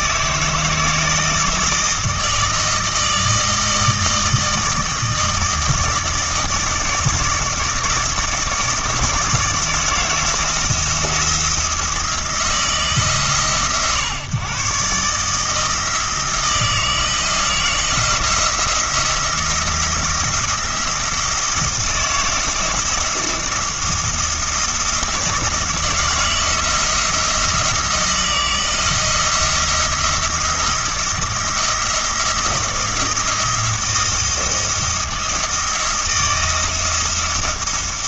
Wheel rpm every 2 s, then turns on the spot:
160, 160, 160, 160, 160, 170, 160, 140, 160, 170, 170, 160, 170, 170, 170, 170, 170, 170, 170.
none